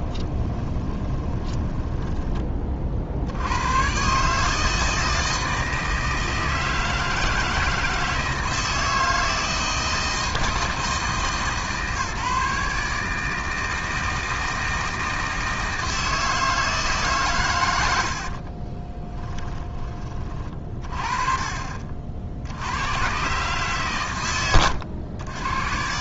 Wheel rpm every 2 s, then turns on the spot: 20, 40, 160, 160, 160, 160, 150, 160, 160, 40, 30, 80, 100.
0-2 18-20